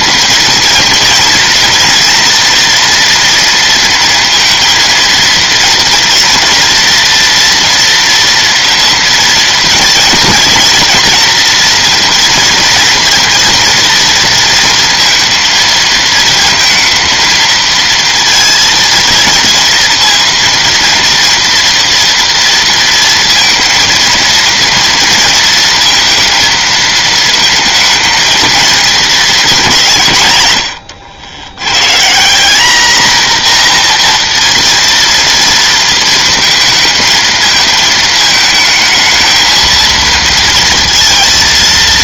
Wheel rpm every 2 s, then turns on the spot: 230, 240, 230, 230, 230, 230, 230, 230, 230, 230, 230, 230, 230, 230, 220, 150, 180, 240, 230, 220, 230.
none